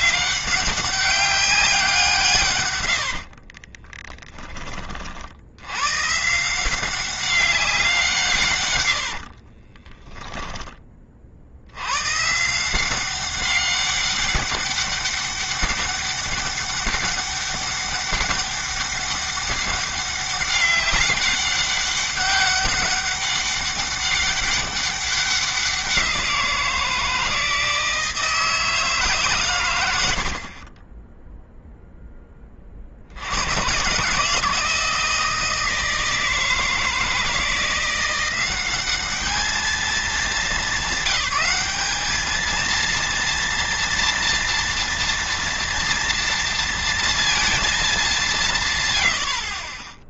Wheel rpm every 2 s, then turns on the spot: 200, 110, 30, 180, 110, 20, 180, 200, 200, 200, 200, 200, 200, 170, 150, 30, 50, 160, 160, 200, 200, 230, 230, 230, 150.
2-4 8-10